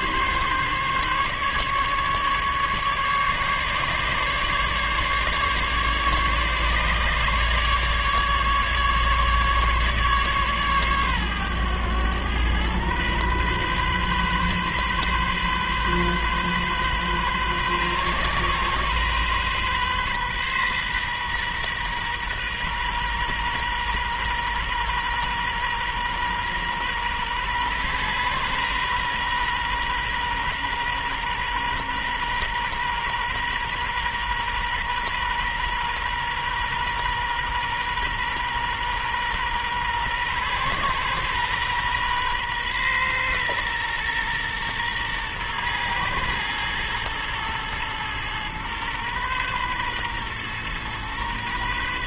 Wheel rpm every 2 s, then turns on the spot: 140, 140, 140, 140, 150, 130, 120, 130, 130, 130, 130, 120, 120, 120, 120, 120, 120, 120, 120, 120, 130, 120, 120, 120, 120, 120.
none